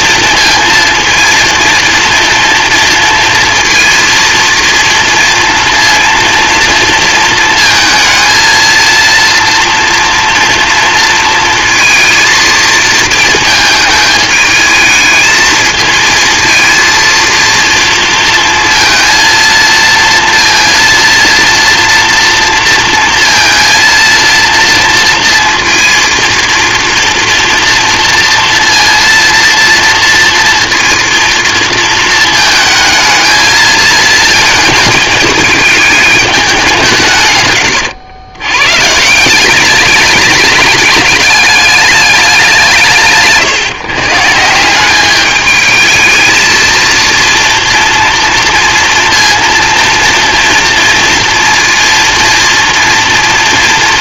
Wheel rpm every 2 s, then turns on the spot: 230, 230, 230, 230, 230, 230, 230, 220, 230, 230, 230, 230, 230, 230, 230, 230, 220, 220, 180, 140, 210, 160, 180, 230, 230, 230, 230.
none